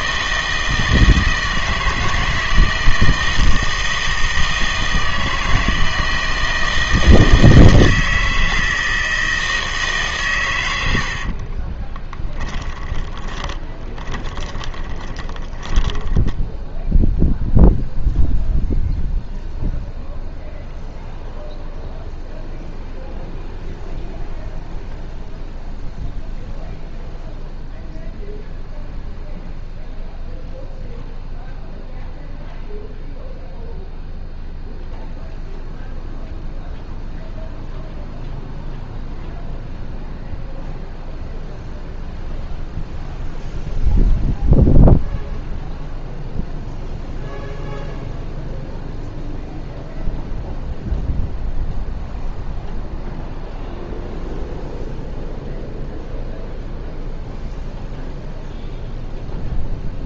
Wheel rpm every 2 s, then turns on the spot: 160, 160, 160, 160, 160, 100, 20, 20, 0, 0, 0, 0, 0, 0, 0, 0, 0, 0, 0, 0, 0, 0, 0, 0, 0, 0, 0, 0, 0, 0.
12-16